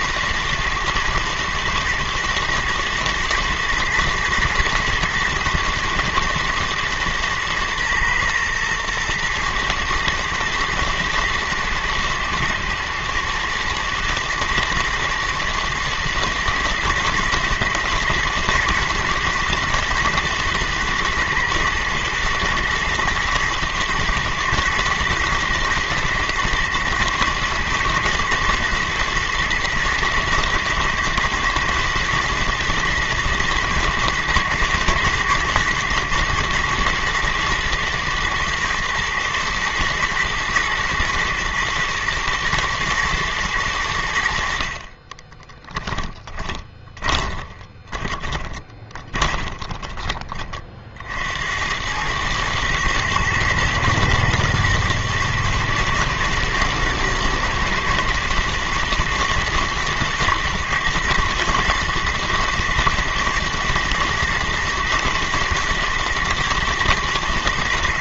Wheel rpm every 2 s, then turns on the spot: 120, 120, 120, 110, 120, 120, 110, 120, 120, 120, 110, 110, 120, 110, 120, 110, 120, 110, 110, 120, 120, 110, 60, 20, 20, 40, 110, 110, 110, 110, 110, 110, 110, 120.
44-50